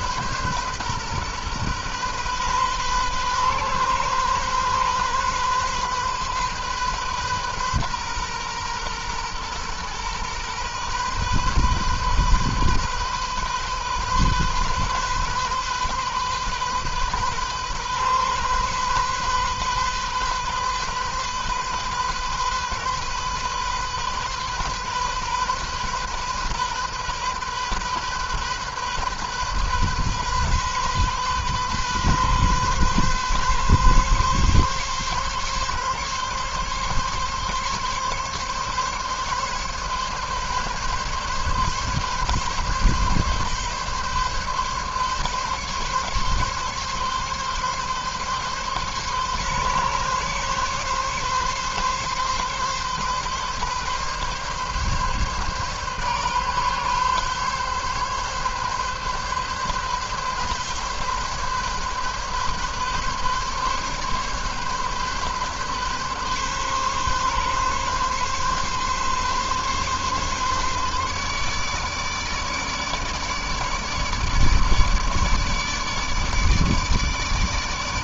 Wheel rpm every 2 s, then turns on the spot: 130, 130, 130, 130, 120, 120, 130, 130, 130, 130, 130, 130, 130, 130, 130, 130, 130, 140, 140, 140, 140, 140, 140, 140, 140, 140, 140, 140, 140, 140, 140, 140, 140, 140, 140, 140, 150, 150, 150.
none